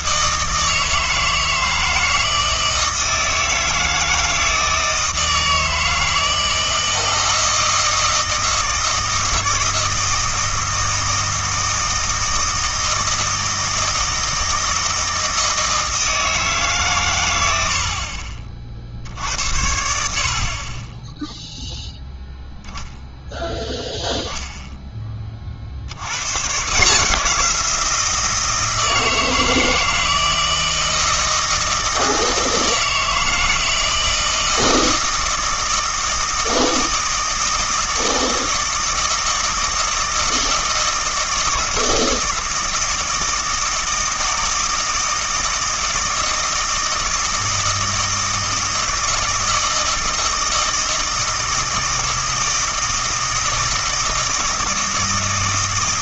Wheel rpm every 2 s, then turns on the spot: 160, 160, 160, 160, 160, 160, 160, 160, 140, 50, 30, 0, 10, 150, 160, 160, 160, 160, 160, 160, 160, 160, 160, 160, 160, 160, 160, 160.
none